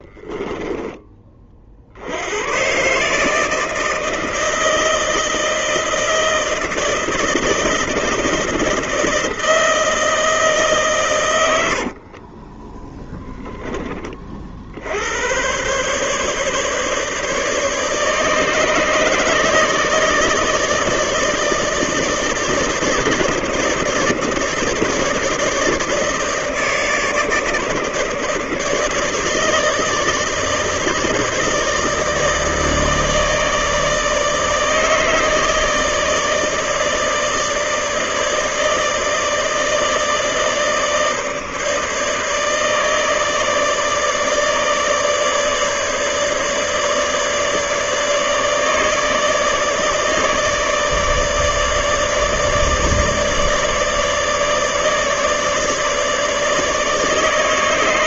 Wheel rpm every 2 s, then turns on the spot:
10, 100, 160, 160, 160, 160, 30, 40, 150, 150, 150, 150, 150, 150, 150, 160, 150, 150, 150, 150, 160, 150, 150, 150, 150, 150, 150, 150, 150.
0-2 12-14